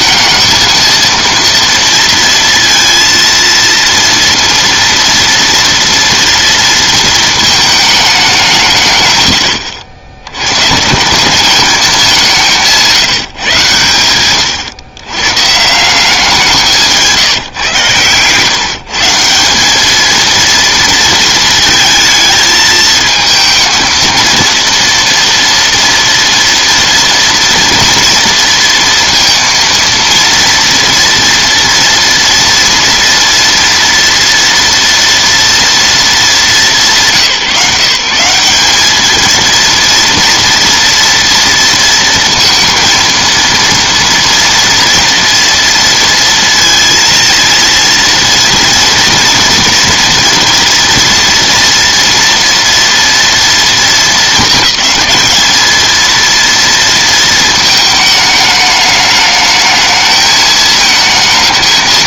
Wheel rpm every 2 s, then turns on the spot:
220, 230, 230, 230, 170, 100, 180, 110, 180, 140, 230, 220, 230, 230, 230, 230, 230, 230, 200, 190, 240, 230, 240, 230, 230, 230, 230, 220, 230, 210, 220.
none